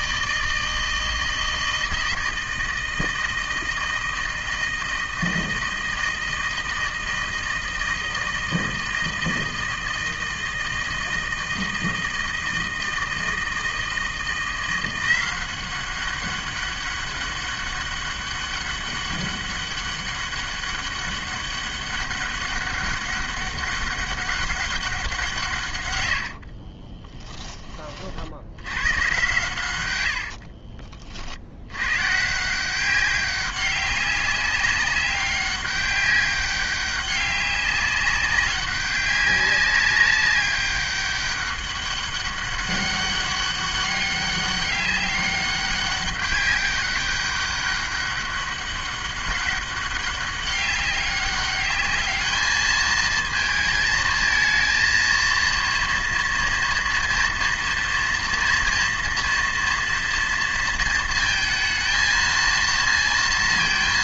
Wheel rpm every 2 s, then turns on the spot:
160, 160, 160, 160, 160, 160, 160, 180, 200, 200, 200, 200, 190, 30, 110, 40, 180, 190, 200, 190, 200, 200, 200, 200, 200, 200, 220, 230, 230, 230, 230, 230.
26-28